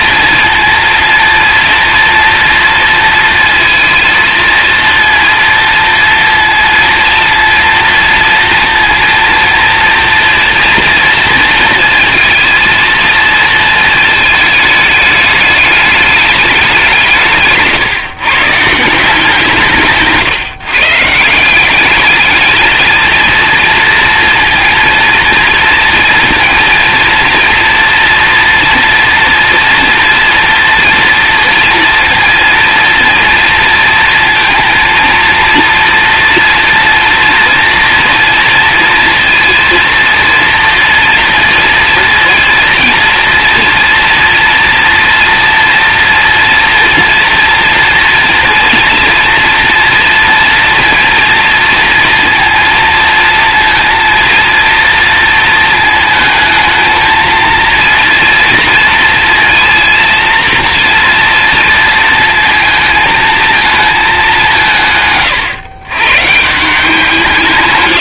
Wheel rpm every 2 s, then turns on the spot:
230, 230, 230, 230, 230, 230, 230, 220, 190, 160, 140, 220, 230, 230, 230, 230, 230, 230, 230, 230, 230, 230, 240, 240, 240, 230, 230, 230, 220, 230, 230, 230, 160, 170.
none